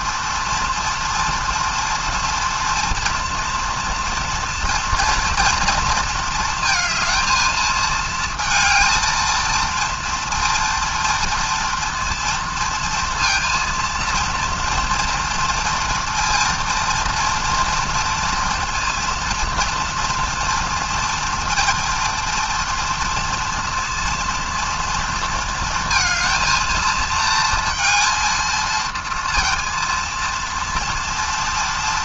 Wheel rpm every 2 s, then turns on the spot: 230, 230, 230, 220, 230, 230, 230, 230, 230, 230, 230, 230, 230, 230, 230, 230.
none